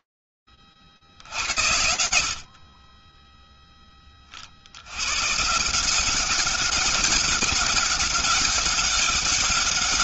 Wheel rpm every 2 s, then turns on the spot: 20, 60, 70, 200, 190.
none